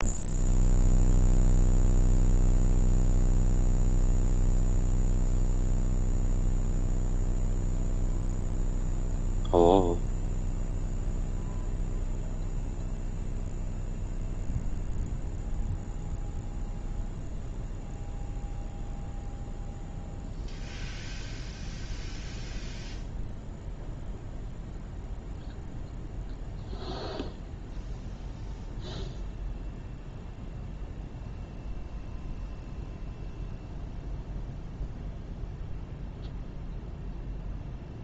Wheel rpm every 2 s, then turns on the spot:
0, 0, 0, 0, 0, 0, 0, 0, 0, 0, 0, 0, 0, 0, 0, 0, 0, 0, 0.
none